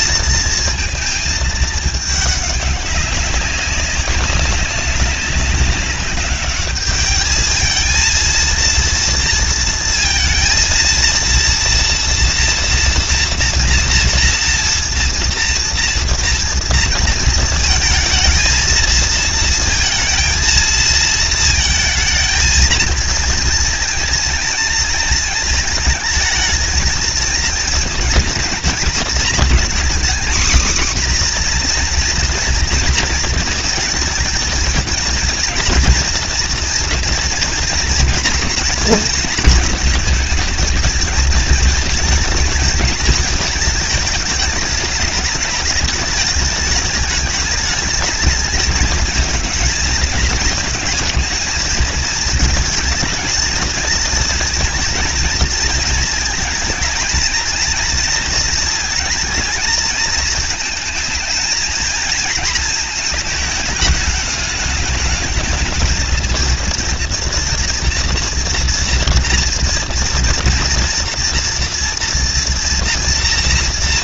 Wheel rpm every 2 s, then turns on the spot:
230, 200, 190, 200, 230, 230, 240, 230, 230, 220, 220, 230, 230, 220, 230, 250, 230, 230, 240, 220, 220, 220, 210, 210, 220, 220, 220, 230, 220, 230, 220, 220, 210, 230, 230, 230, 230.
none